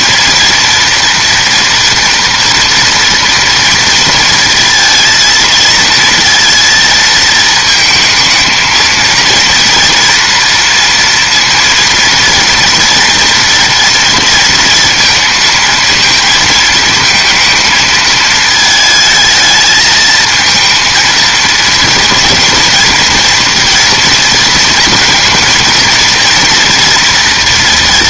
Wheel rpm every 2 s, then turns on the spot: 230, 230, 230, 230, 220, 230, 240, 230, 220, 220, 230, 230, 230, 230.
none